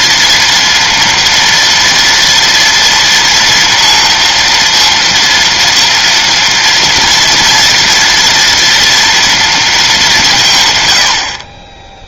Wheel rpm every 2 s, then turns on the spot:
230, 230, 230, 230, 230, 110.
none